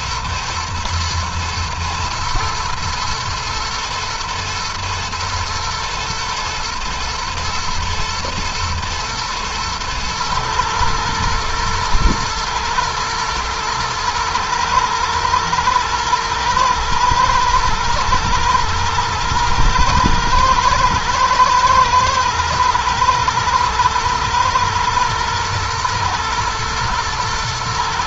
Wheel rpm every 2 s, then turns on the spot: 120, 110, 110, 120, 120, 120, 110, 110, 110, 120, 110, 110, 110, 110.
none